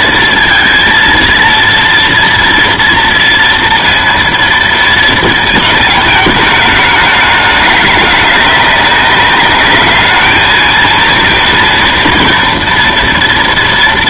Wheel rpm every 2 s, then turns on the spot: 230, 240, 230, 220, 200, 220, 230.
none